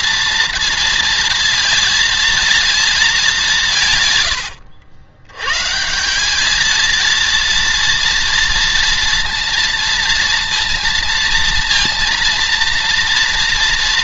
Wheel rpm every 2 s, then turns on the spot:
230, 230, 90, 210, 230, 230, 230.
none